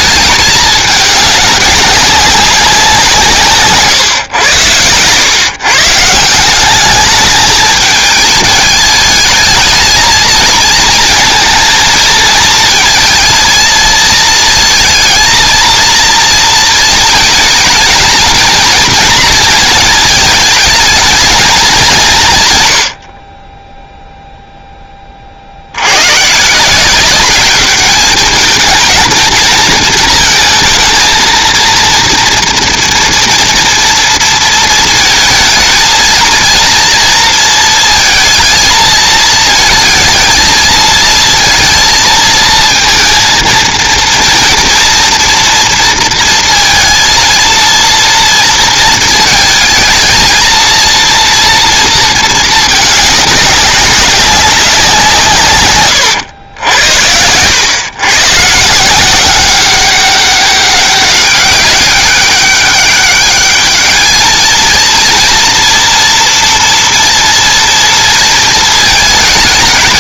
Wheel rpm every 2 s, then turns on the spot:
210, 180, 100, 200, 210, 230, 220, 230, 230, 230, 220, 110, 10, 180, 220, 230, 240, 230, 230, 220, 220, 220, 230, 230, 230, 230, 210, 180, 80, 170, 190, 200, 230, 230, 220.
4-6